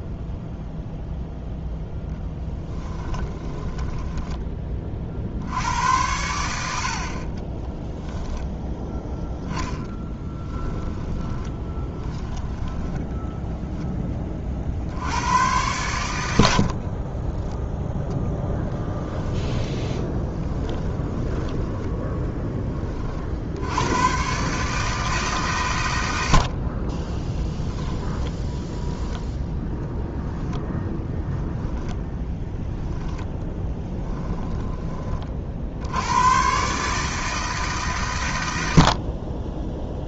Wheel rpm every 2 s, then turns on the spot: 0, 10, 30, 70, 10, 10, 10, 60, 50, 10, 10, 20, 150, 30, 0, 0, 10, 10, 140, 70.
2-4 8-14 16-22